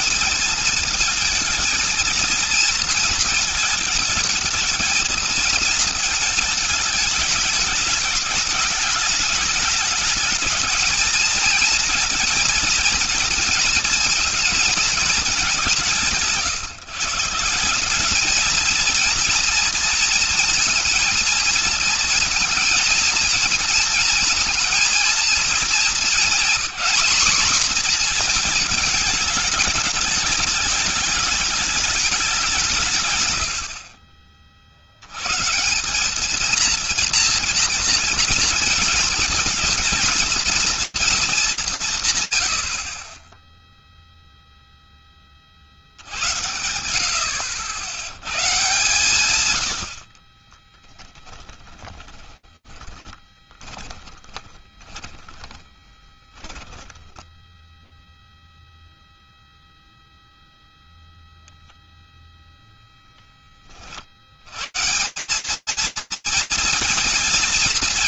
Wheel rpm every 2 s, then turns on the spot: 220, 220, 220, 220, 210, 220, 230, 220, 150, 220, 230, 230, 230, 220, 220, 210, 170, 50, 210, 220, 230, 80, 0, 100, 120, 30, 20, 20, 10, 0, 0, 20, 190, 210.
50-58